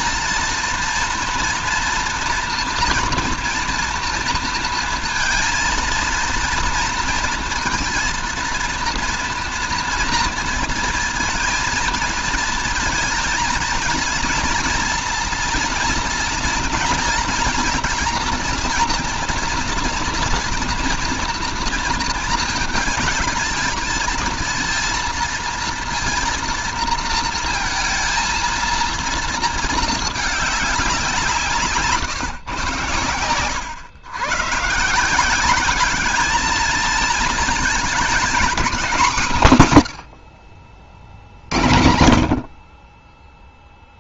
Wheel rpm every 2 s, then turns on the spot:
230, 230, 230, 230, 230, 230, 230, 230, 230, 230, 230, 220, 230, 230, 230, 200, 120, 140, 220, 220, 80, 60.
none